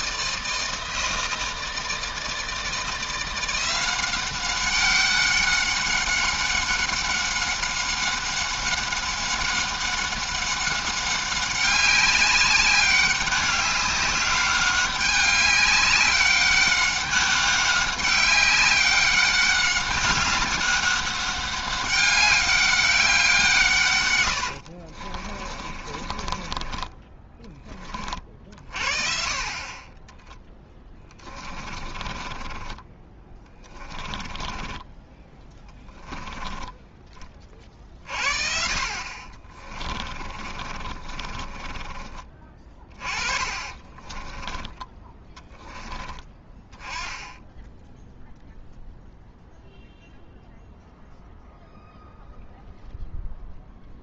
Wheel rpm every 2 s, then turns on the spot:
160, 170, 190, 190, 190, 200, 200, 200, 200, 200, 200, 190, 40, 20, 50, 10, 20, 20, 20, 50, 40, 30, 20, 10, 0, 0, 0.
24-28 30-36 40-44